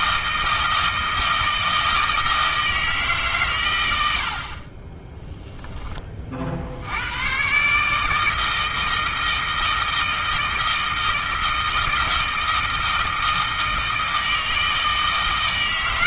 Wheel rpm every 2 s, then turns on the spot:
160, 150, 20, 80, 160, 160, 160, 160.
none